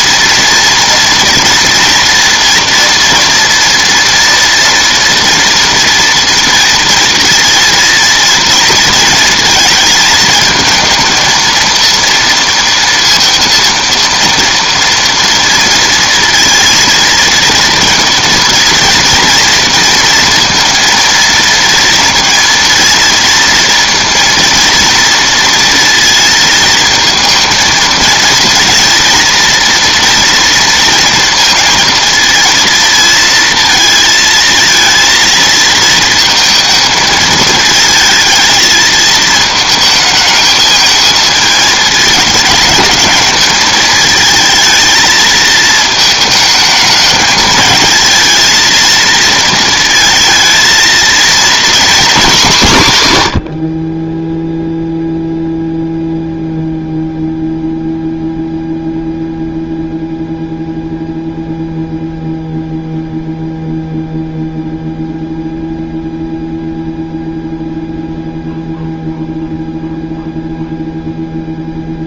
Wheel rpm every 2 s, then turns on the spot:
240, 230, 230, 230, 230, 220, 230, 230, 230, 230, 230, 230, 230, 220, 230, 230, 230, 230, 220, 220, 220, 220, 220, 220, 230, 230, 120, 0, 0, 0, 0, 0, 0, 0, 0, 0.
none